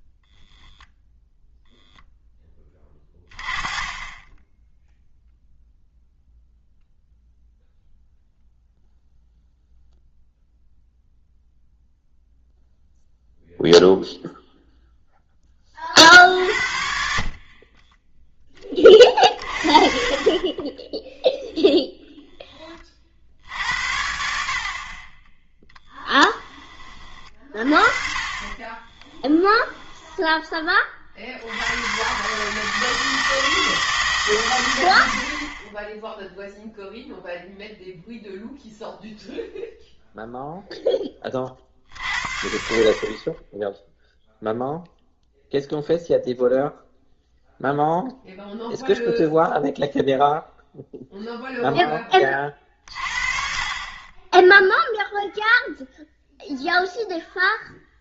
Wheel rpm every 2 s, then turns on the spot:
0, 20, 0, 0, 0, 0, 0, 0, 60, 20, 20, 20, 50, 30, 30, 20, 150, 110, 0, 0, 0, 50, 0, 0, 0, 0, 40, 0, 0.
20-22 28-30